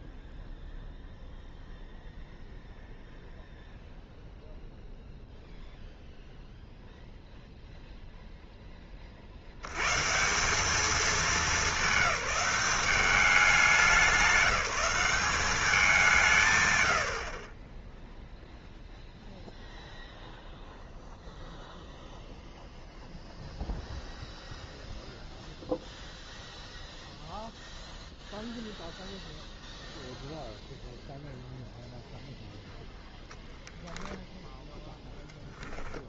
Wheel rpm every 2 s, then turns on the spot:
0, 0, 0, 0, 0, 190, 190, 180, 140, 0, 0, 0, 0, 0, 0, 0, 0, 0.
none